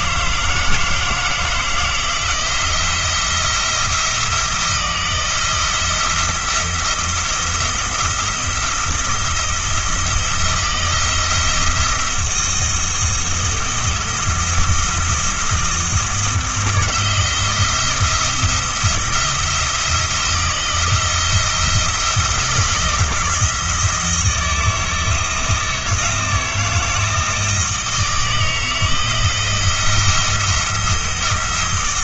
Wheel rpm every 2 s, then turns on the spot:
160, 170, 160, 170, 170, 170, 170, 170, 170, 170, 160, 160, 160, 170, 170, 170.
none